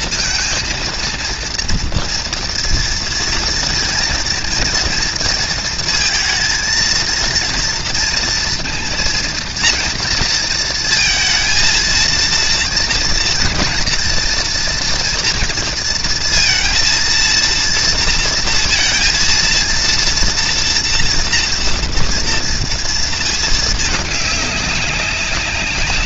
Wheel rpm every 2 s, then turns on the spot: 230, 230, 230, 230, 230, 230, 230, 230, 230, 230, 230, 230, 200.
none